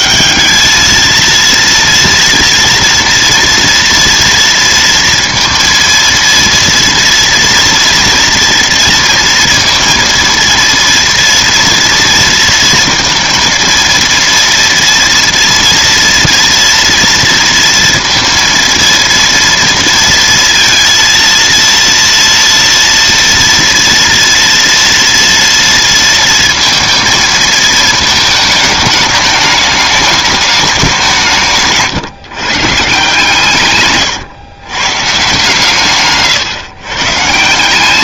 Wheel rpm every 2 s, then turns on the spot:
210, 230, 230, 230, 230, 230, 230, 230, 230, 230, 230, 240, 230, 230, 220, 210, 150, 130, 140.
none